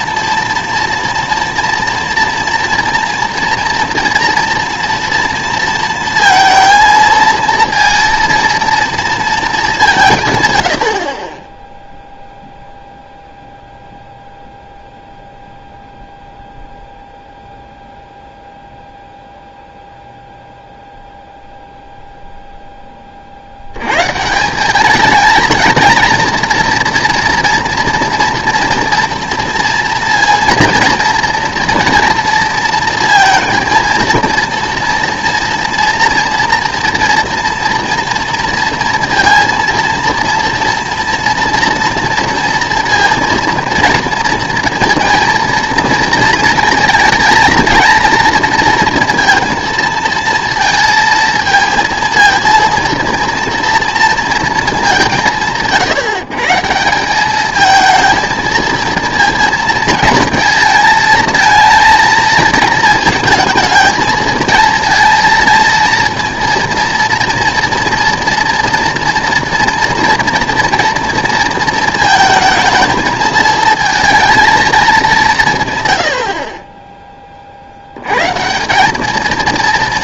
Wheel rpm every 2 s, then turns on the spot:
240, 230, 230, 230, 230, 120, 0, 0, 0, 0, 0, 0, 180, 230, 230, 230, 240, 230, 230, 240, 230, 230, 230, 230, 230, 230, 230, 220, 160, 230, 230, 230, 230, 230, 240, 230, 220, 220, 30, 160.
none